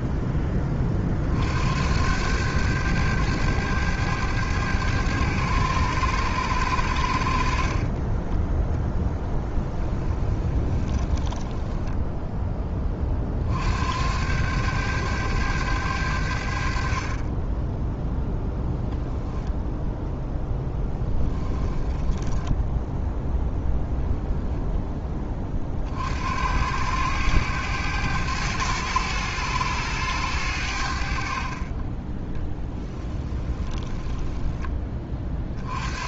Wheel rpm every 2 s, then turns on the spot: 30, 100, 100, 80, 0, 10, 20, 100, 40, 0, 10, 10, 10, 90, 100, 70, 10, 20.
10-12 20-22 32-34